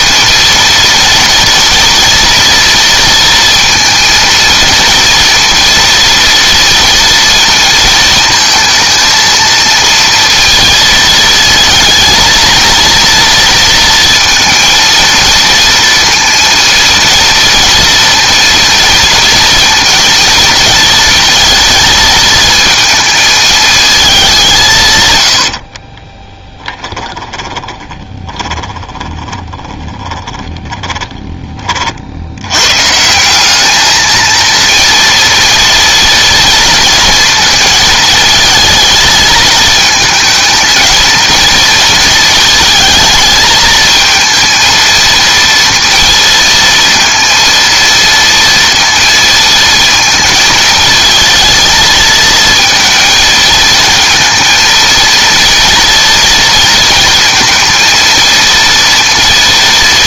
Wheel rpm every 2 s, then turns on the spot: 230, 230, 230, 230, 220, 230, 230, 230, 230, 230, 230, 220, 160, 10, 20, 20, 130, 230, 230, 220, 220, 220, 230, 230, 230, 230, 230, 230, 230, 230.
26-32